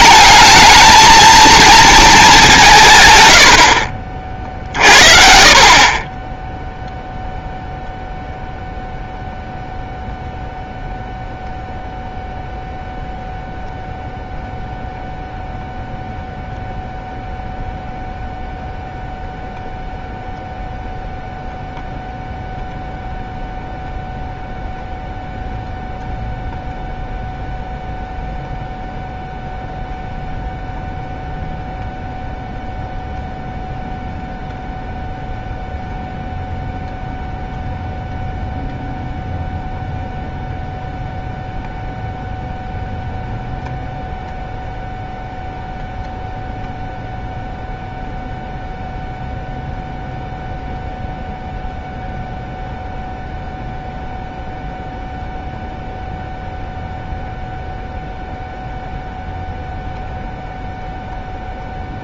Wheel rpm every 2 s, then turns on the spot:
220, 170, 50, 0, 0, 0, 0, 0, 0, 0, 0, 0, 0, 0, 0, 0, 0, 0, 0, 0, 0, 0, 0, 0, 0, 0, 0, 0, 0, 0, 0.
none